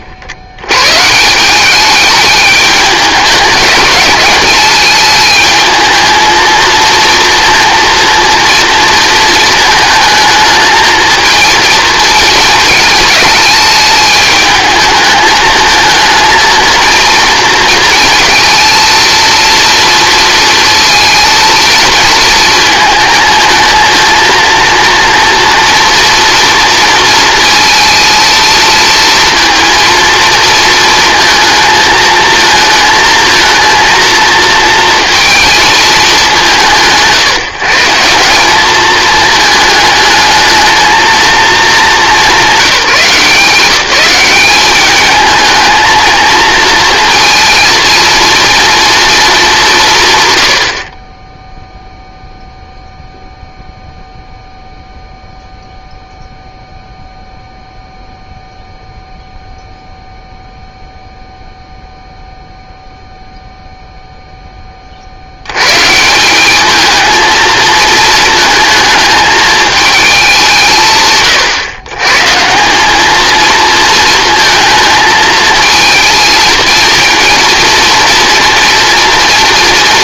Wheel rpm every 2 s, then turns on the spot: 120, 210, 220, 230, 230, 220, 220, 210, 230, 230, 230, 220, 230, 230, 230, 230, 230, 230, 170, 210, 220, 190, 210, 230, 230, 50, 0, 0, 0, 0, 0, 0, 30, 210, 220, 160, 200, 220, 230, 230.
none